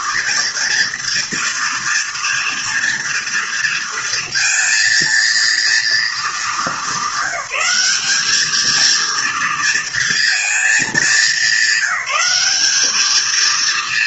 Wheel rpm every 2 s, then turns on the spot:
230, 240, 230, 210, 220, 220, 200.
none